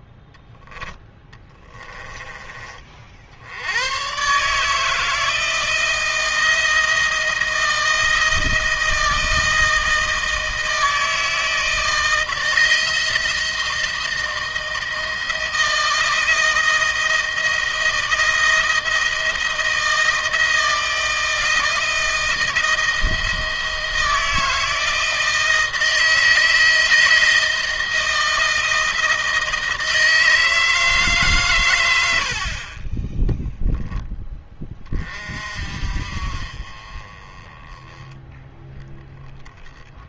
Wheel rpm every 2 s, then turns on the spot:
10, 50, 160, 170, 160, 160, 170, 170, 170, 160, 160, 160, 160, 160, 160, 150, 30, 30, 30, 10.
none